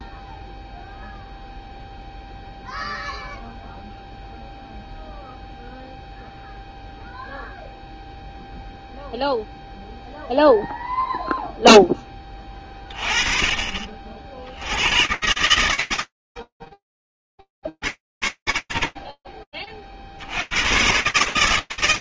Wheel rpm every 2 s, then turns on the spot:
0, 0, 0, 0, 0, 0, 30, 90, 40, 50, 80.
none